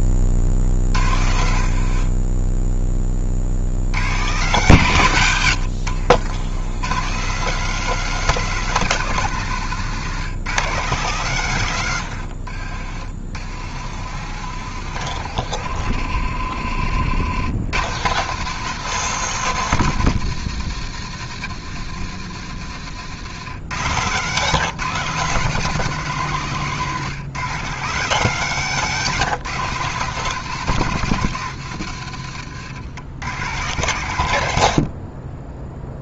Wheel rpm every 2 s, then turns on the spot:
60, 40, 100, 170, 170, 150, 60, 70, 80, 180, 120, 100, 160, 140, 160, 140, 90, 30.
0-2 12-16